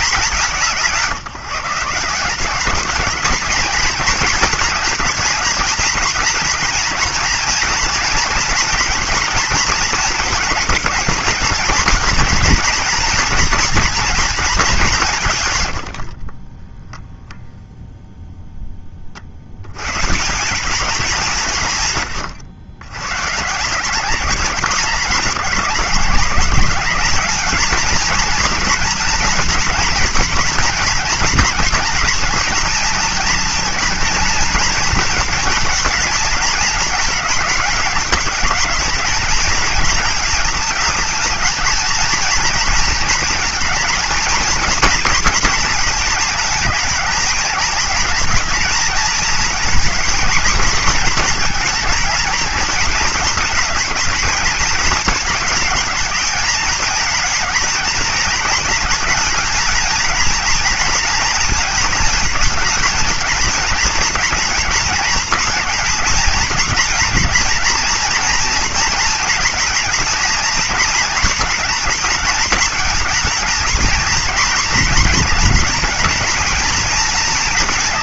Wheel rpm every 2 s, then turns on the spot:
190, 180, 220, 230, 230, 220, 240, 220, 30, 0, 180, 110, 200, 200, 240, 230, 220, 230, 220, 210, 220, 230, 230, 220, 230, 220, 220, 220, 220, 230, 230, 220, 230, 230, 230, 230, 220, 240, 230.
16-18